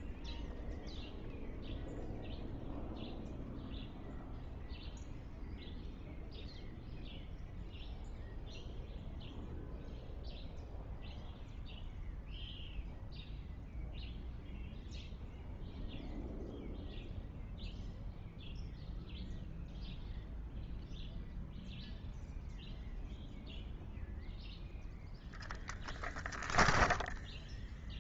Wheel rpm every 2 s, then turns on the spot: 0, 0, 0, 0, 0, 0, 0, 0, 0, 0, 0, 0, 10, 10.
26-28